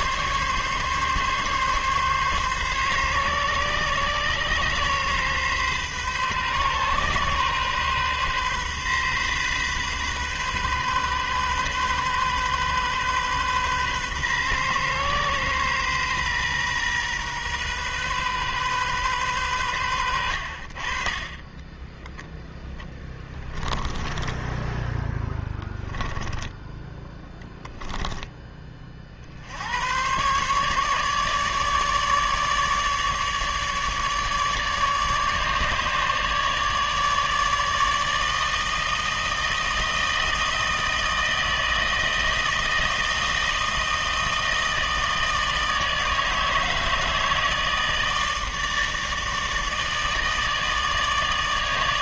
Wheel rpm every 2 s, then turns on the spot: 140, 140, 130, 130, 130, 130, 130, 130, 130, 130, 70, 10, 20, 10, 20, 130, 150, 150, 150, 160, 160, 160, 160, 160, 160, 160.
22-28